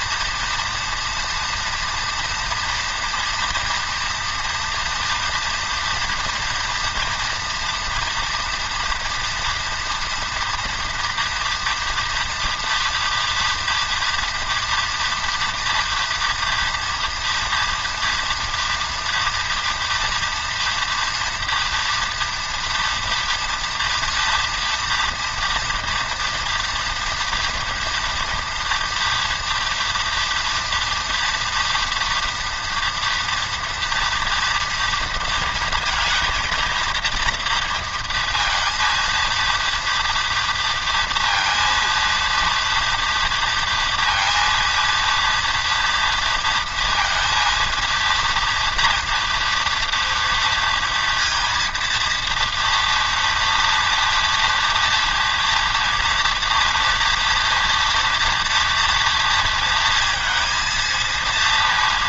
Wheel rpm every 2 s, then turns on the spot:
240, 240, 230, 230, 230, 230, 230, 230, 230, 230, 230, 230, 240, 230, 240, 230, 230, 230, 220, 230, 230, 230, 230, 230, 230, 230, 230, 230, 230, 230, 230.
none